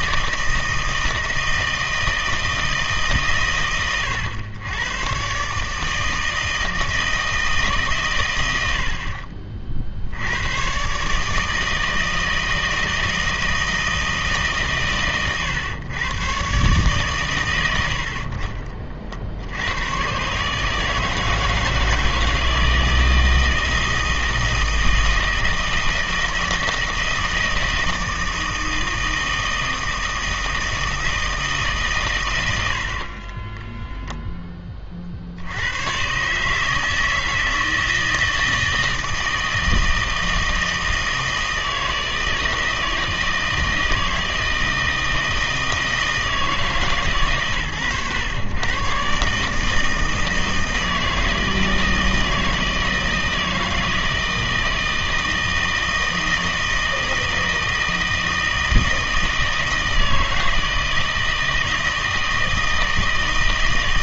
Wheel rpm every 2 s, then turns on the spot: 160, 160, 110, 160, 80, 120, 160, 140, 140, 40, 150, 160, 160, 160, 160, 160, 70, 30, 160, 160, 160, 160, 160, 140, 120, 160, 160, 160, 160, 160, 160, 160.
none